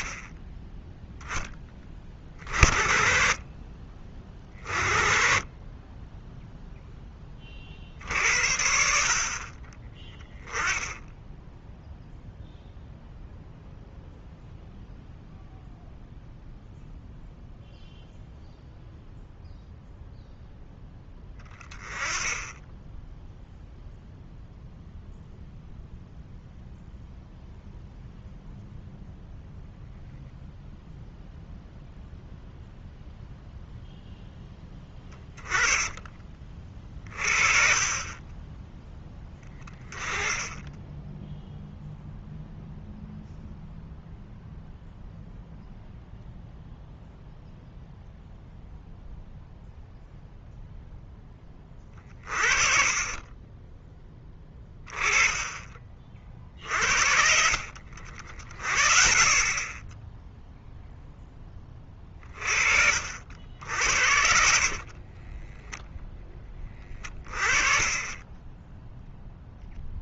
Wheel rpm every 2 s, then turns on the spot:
10, 60, 40, 0, 60, 10, 0, 0, 0, 0, 10, 10, 0, 0, 0, 0, 0, 20, 40, 10, 10, 0, 0, 0, 0, 0, 30, 20, 50, 50, 0, 40, 30, 20, 10.
34-36 64-66